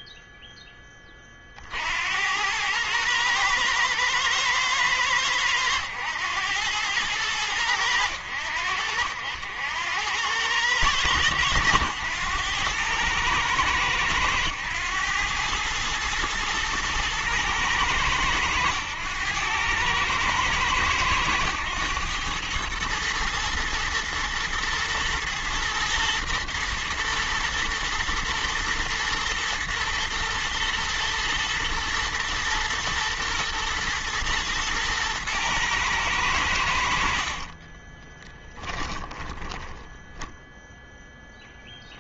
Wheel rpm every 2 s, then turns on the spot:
10, 90, 110, 100, 90, 100, 100, 110, 110, 100, 110, 110, 110, 110, 110, 110, 120, 120, 90, 20, 0.
38-40